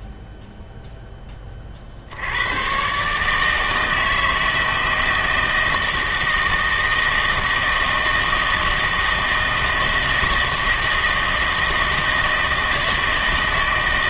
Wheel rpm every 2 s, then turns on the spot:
0, 120, 160, 160, 160, 160, 160.
none